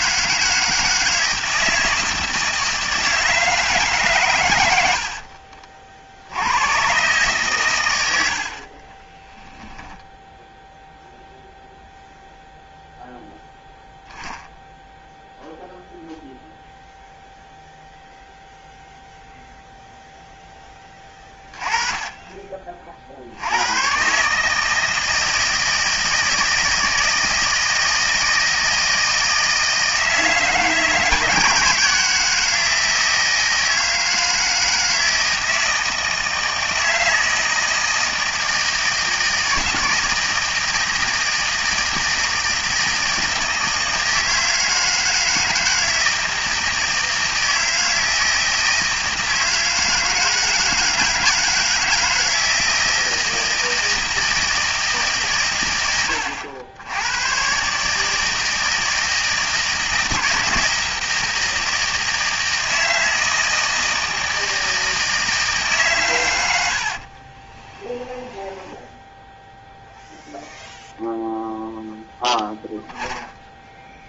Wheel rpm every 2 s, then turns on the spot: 160, 160, 90, 110, 40, 0, 0, 0, 0, 0, 10, 40, 150, 160, 160, 160, 160, 160, 160, 160, 160, 160, 160, 160, 160, 160, 160, 160, 80, 160, 160, 160, 160, 70, 10, 0, 0.
68-70